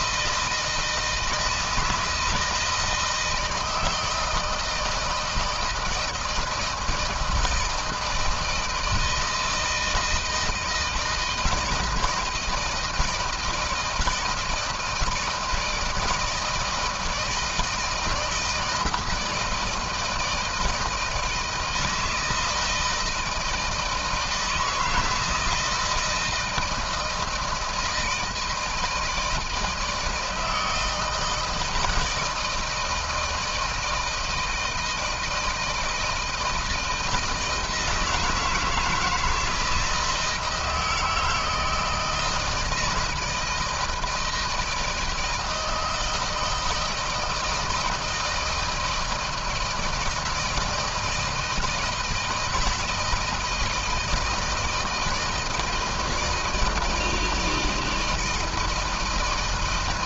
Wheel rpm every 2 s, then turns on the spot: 160, 160, 160, 160, 160, 160, 160, 160, 170, 160, 160, 160, 160, 160, 170, 160, 160, 160, 160, 160, 160, 160, 160, 160, 160, 160, 160, 160, 160, 160.
none